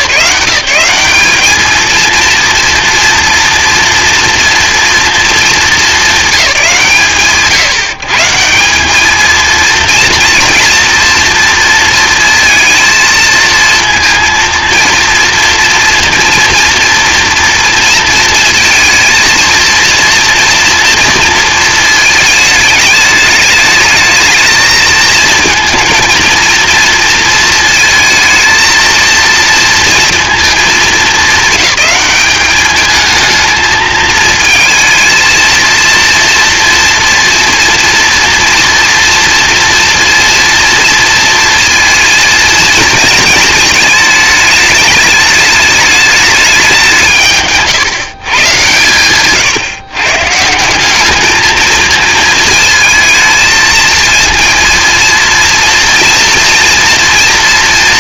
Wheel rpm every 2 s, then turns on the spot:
170, 230, 220, 120, 200, 240, 230, 230, 230, 230, 230, 210, 220, 230, 220, 220, 220, 230, 230, 240, 230, 220, 210, 180, 120, 190, 220, 230, 230.
none